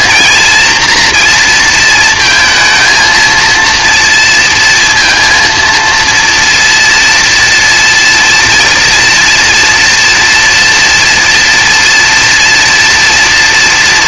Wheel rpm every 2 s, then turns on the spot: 230, 230, 230, 230, 240, 240, 230.
none